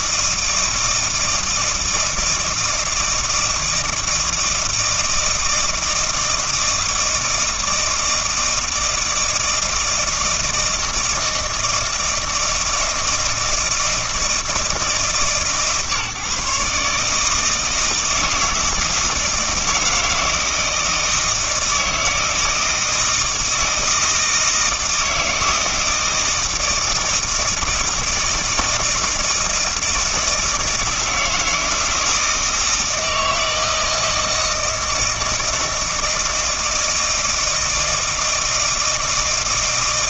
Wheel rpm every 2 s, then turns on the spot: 160, 160, 160, 160, 160, 160, 160, 160, 150, 160, 160, 160, 160, 160, 160, 160, 160, 160, 160, 160.
none